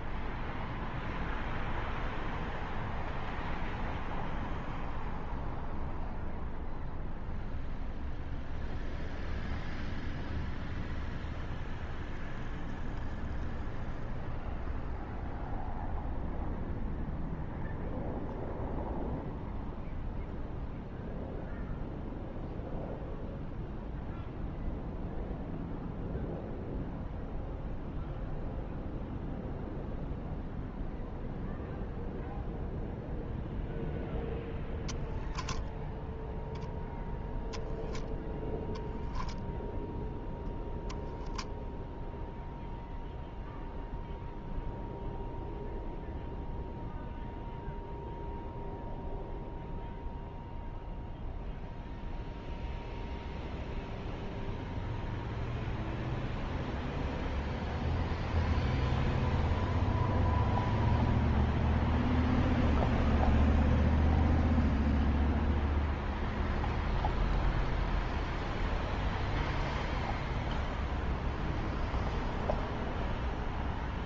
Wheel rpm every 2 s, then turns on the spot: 0, 0, 0, 0, 0, 0, 0, 0, 0, 0, 0, 0, 0, 0, 0, 0, 0, 10, 0, 0, 0, 0, 0, 0, 0, 0, 0, 0, 0, 0, 0, 0, 0, 0, 0, 0, 0.
none